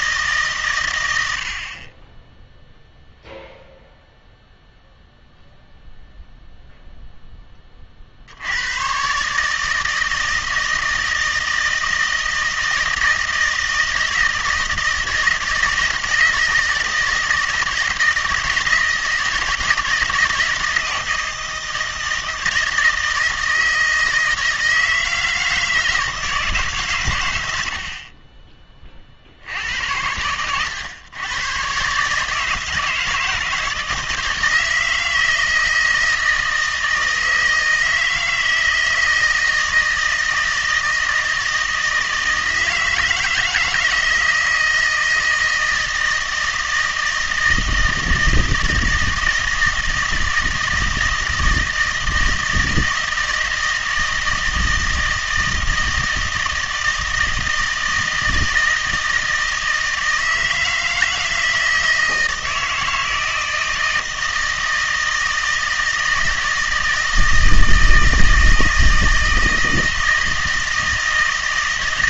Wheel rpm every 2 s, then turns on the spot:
120, 0, 0, 0, 110, 160, 160, 160, 160, 160, 160, 160, 160, 140, 30, 110, 160, 160, 160, 160, 160, 160, 160, 160, 160, 160, 160, 160, 160, 160, 160, 160, 160, 160, 160, 160.
none